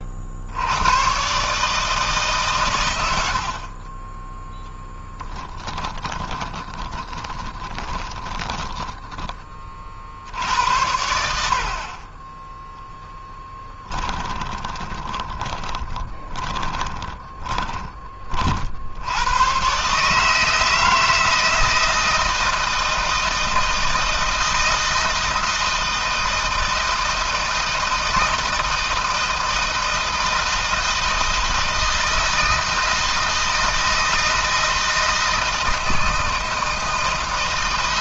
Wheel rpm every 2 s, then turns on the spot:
70, 130, 10, 20, 10, 90, 10, 20, 20, 50, 160, 160, 160, 160, 160, 160, 160, 160, 160.
6-10 14-18